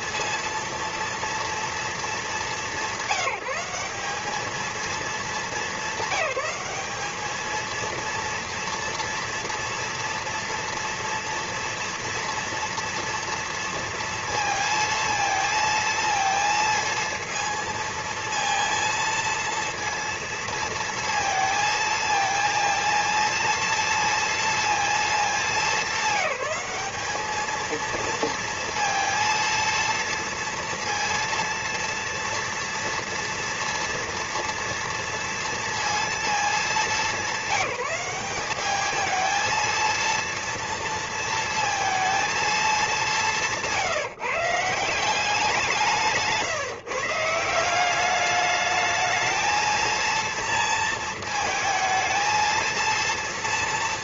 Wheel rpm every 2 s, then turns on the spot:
230, 200, 220, 200, 230, 230, 230, 230, 220, 230, 230, 230, 230, 200, 230, 230, 230, 230, 220, 200, 230, 220, 160, 150, 210, 230, 230.
none